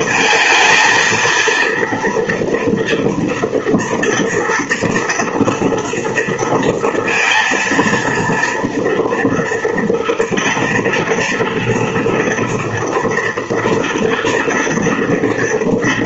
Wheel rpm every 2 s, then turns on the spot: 230, 230, 240, 230, 230, 230, 240, 230.
none